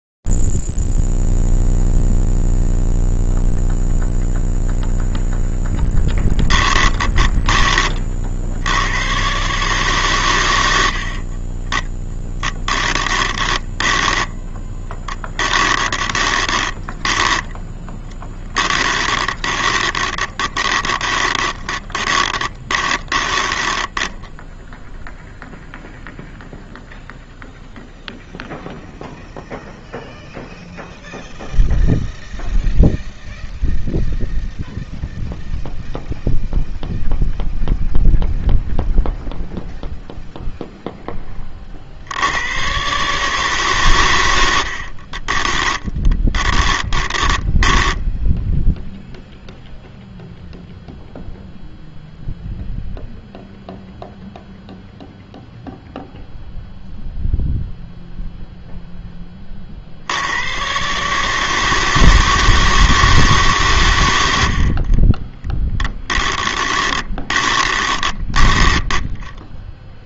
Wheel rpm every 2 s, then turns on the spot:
0, 0, 0, 10, 50, 120, 10, 10, 20, 10, 20, 20, 0, 0, 0, 0, 0, 0, 0, 0, 20, 150, 30, 10, 0, 0, 0, 0, 0, 10, 140, 160, 40, 20, 10.
6-8 12-24 44-48 64-70